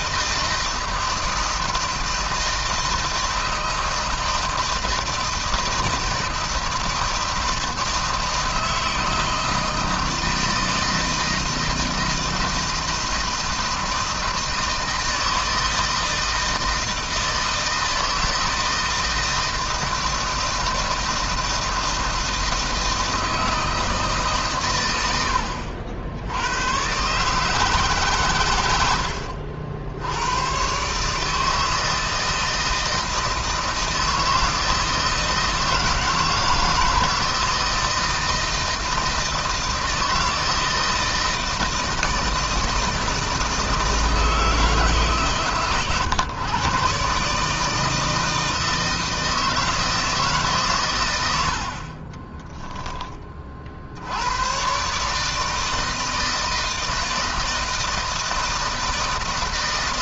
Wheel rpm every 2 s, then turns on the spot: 160, 160, 160, 160, 160, 160, 160, 160, 160, 160, 160, 160, 100, 120, 90, 140, 160, 160, 160, 160, 160, 160, 150, 140, 160, 120, 10, 140, 160, 160.
none